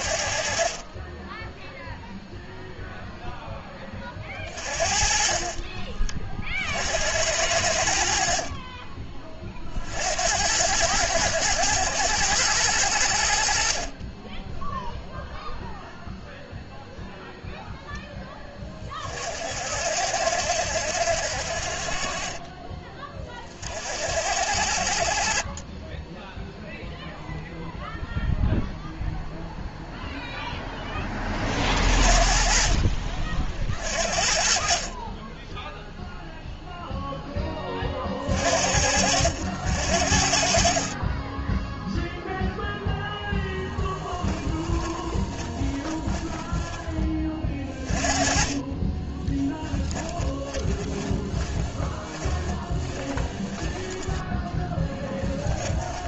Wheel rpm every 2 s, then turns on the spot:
20, 0, 40, 70, 30, 100, 90, 0, 0, 30, 70, 30, 50, 0, 0, 10, 40, 30, 0, 60, 30, 10, 20, 20, 20, 20, 20, 10.
44-46 48-56